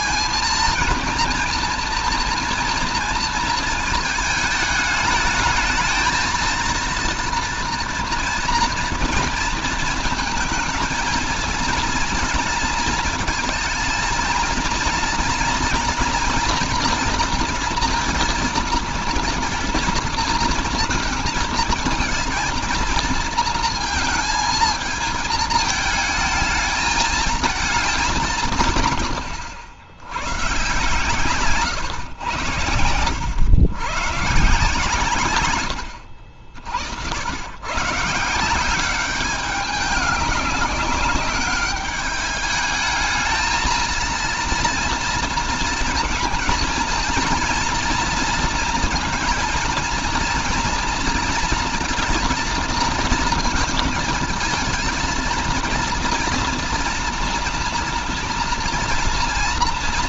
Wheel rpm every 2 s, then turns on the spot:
230, 230, 210, 230, 230, 220, 230, 230, 230, 230, 230, 230, 220, 220, 140, 130, 90, 140, 70, 190, 190, 210, 230, 230, 230, 230, 230, 220, 230, 230.
none